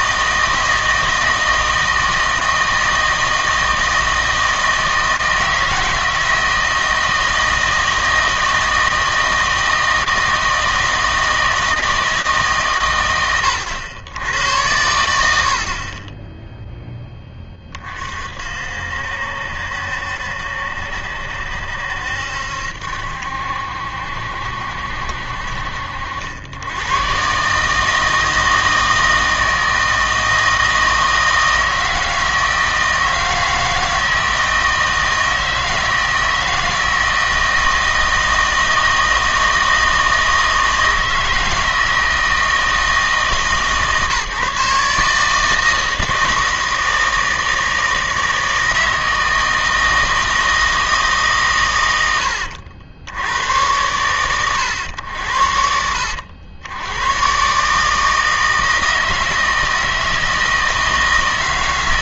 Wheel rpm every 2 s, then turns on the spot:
160, 160, 160, 160, 160, 160, 130, 90, 0, 60, 70, 70, 60, 100, 160, 160, 160, 160, 160, 160, 160, 160, 150, 160, 160, 160, 80, 100, 90, 160, 160.
none